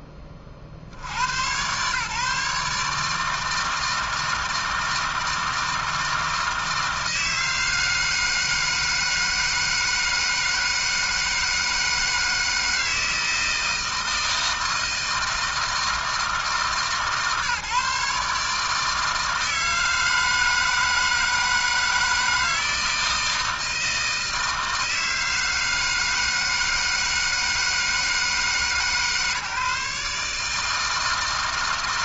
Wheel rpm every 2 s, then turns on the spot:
90, 150, 160, 160, 160, 160, 160, 160, 140, 160, 160, 160, 160, 160, 150, 160.
none